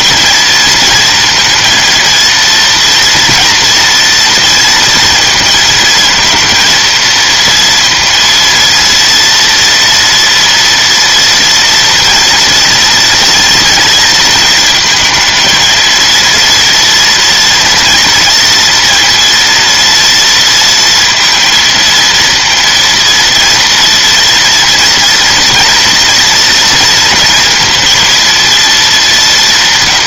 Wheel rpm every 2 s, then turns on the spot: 230, 230, 230, 230, 230, 230, 230, 230, 230, 230, 230, 230, 230, 230, 210.
none